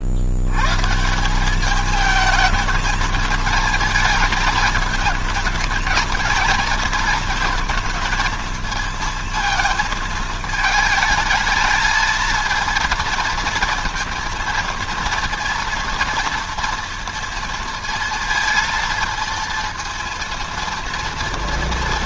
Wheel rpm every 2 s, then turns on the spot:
100, 220, 220, 230, 230, 220, 220, 230, 230, 230, 230.
none